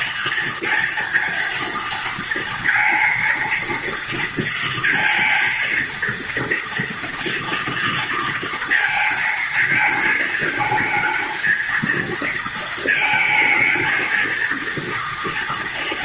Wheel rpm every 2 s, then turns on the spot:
230, 230, 230, 230, 230, 220, 230, 230.
none